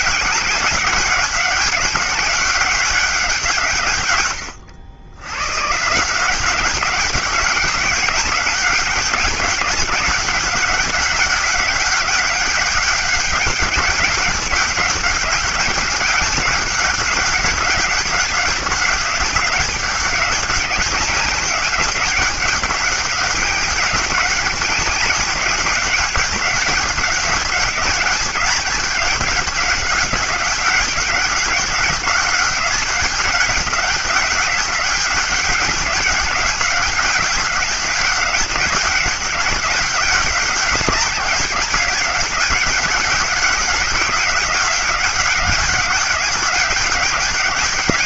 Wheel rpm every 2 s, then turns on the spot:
200, 200, 100, 190, 190, 200, 200, 200, 200, 190, 190, 190, 200, 200, 200, 190, 200, 200, 200, 200, 200, 200, 200, 200.
none